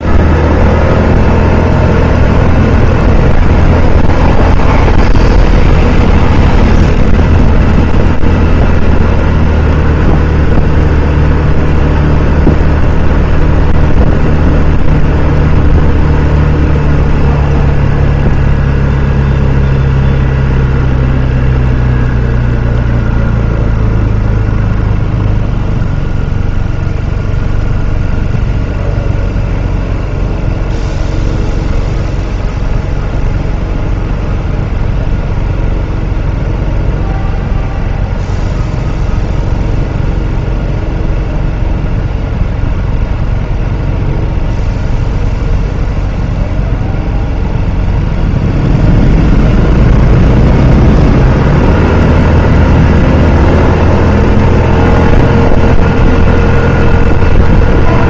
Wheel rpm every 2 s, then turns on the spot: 0, 0, 0, 0, 0, 0, 0, 0, 0, 0, 0, 0, 0, 0, 0, 0, 0, 0, 0, 0, 0, 0, 0, 0, 0, 0, 0, 0, 0.
none